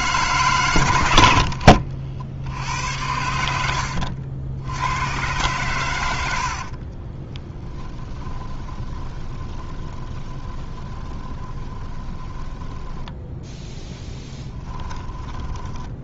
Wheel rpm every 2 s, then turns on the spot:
100, 90, 80, 40, 20, 20, 10, 10.
6-16